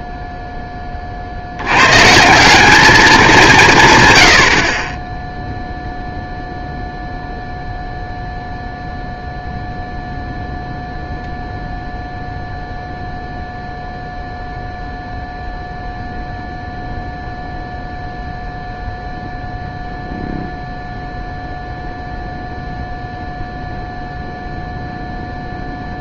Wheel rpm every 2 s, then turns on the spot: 50, 190, 0, 0, 0, 0, 0, 0, 0, 0, 0, 0, 0.
none